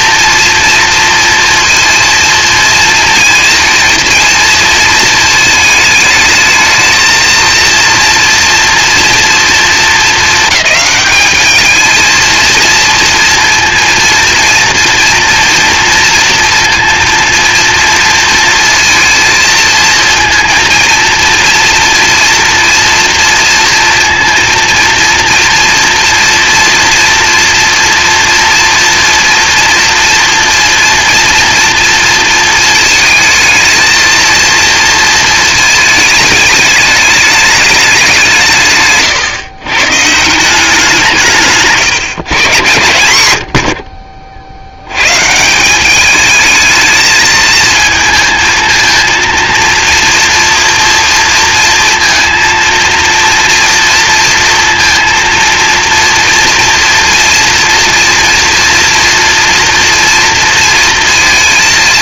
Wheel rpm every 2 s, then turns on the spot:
230, 230, 230, 220, 240, 210, 230, 230, 230, 230, 230, 230, 230, 230, 230, 230, 230, 230, 210, 150, 180, 120, 90, 220, 220, 230, 230, 230, 230, 240, 230.
38-40